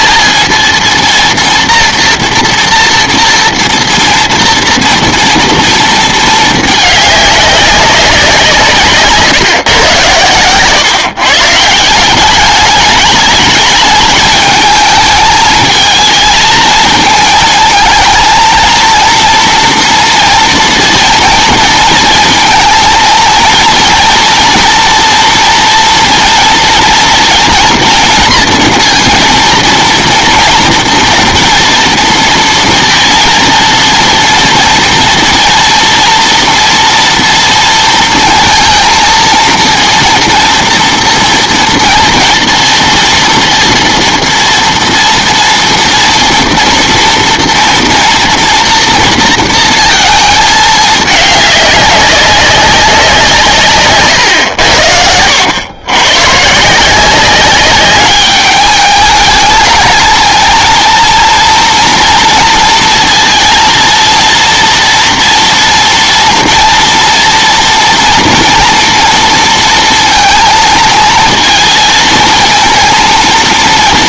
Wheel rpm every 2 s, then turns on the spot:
230, 230, 230, 210, 140, 130, 210, 220, 230, 230, 230, 230, 230, 230, 230, 230, 230, 230, 230, 230, 230, 230, 230, 230, 230, 210, 190, 80, 170, 210, 230, 230, 230, 230, 230, 230, 230.
none